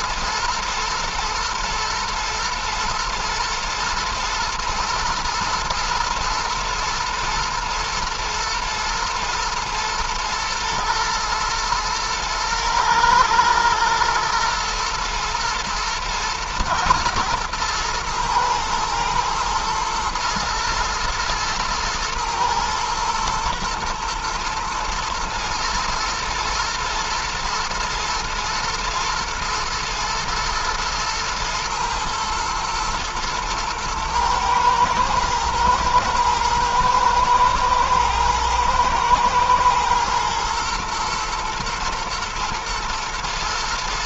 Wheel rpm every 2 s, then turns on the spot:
110, 120, 120, 120, 110, 110, 110, 120, 120, 120, 120, 110, 120, 110, 110, 120, 110, 110, 120, 120, 120, 110.
none